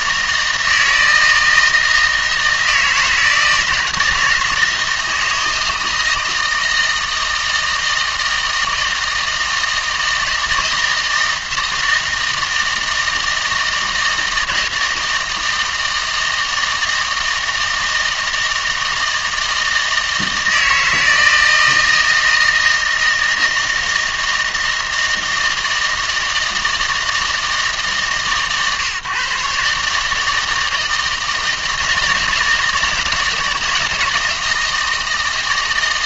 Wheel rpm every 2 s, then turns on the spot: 160, 160, 160, 160, 160, 160, 160, 160, 160, 160, 160, 160, 160, 160, 140, 160, 160, 160.
none